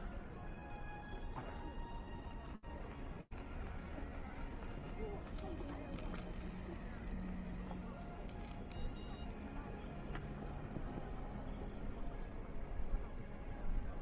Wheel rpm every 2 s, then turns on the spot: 0, 0, 0, 0, 0, 0, 0.
none